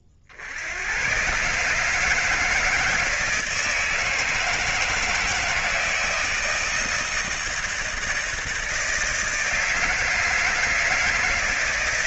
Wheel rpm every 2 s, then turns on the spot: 50, 160, 160, 160, 160, 160.
none